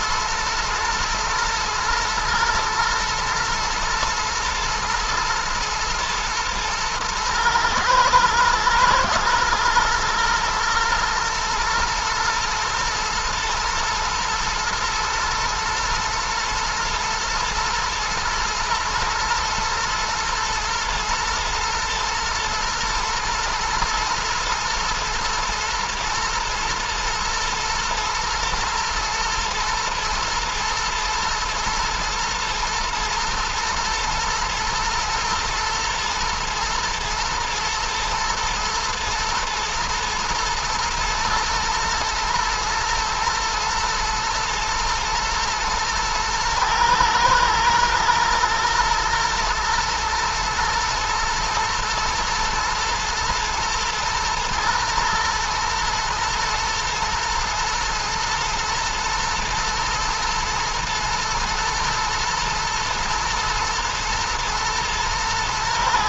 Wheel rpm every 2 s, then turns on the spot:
120, 120, 120, 110, 110, 110, 120, 110, 120, 110, 110, 120, 120, 110, 110, 110, 110, 110, 110, 110, 110, 120, 120, 110, 120, 110, 110, 110, 120, 110, 110, 120, 120.
none